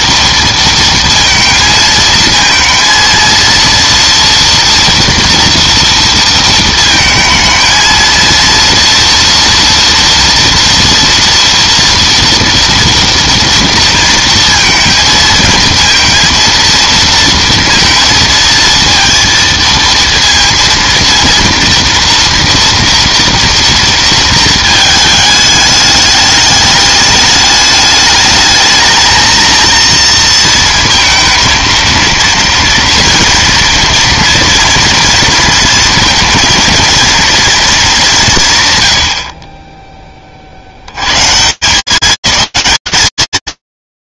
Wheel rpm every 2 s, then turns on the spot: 230, 230, 230, 220, 230, 240, 230, 230, 230, 230, 230, 230, 220, 210, 220, 220, 230, 230, 230, 110, 140, 220.
none